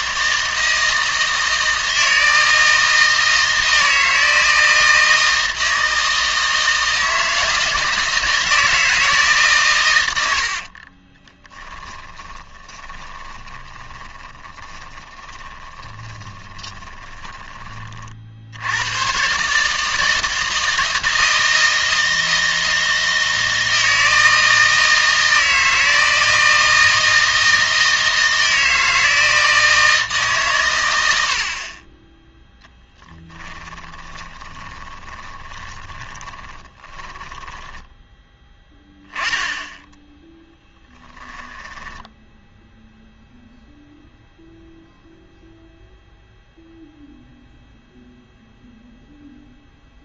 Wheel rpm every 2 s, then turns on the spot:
160, 160, 160, 160, 160, 50, 20, 20, 20, 90, 160, 160, 160, 160, 160, 120, 10, 20, 20, 10, 10, 0, 0, 0, 0.
10-18 32-38 40-42